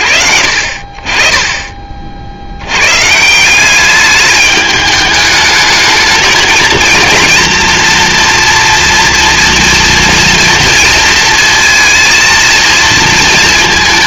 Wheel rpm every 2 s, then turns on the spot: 50, 150, 210, 230, 230, 230, 220.
none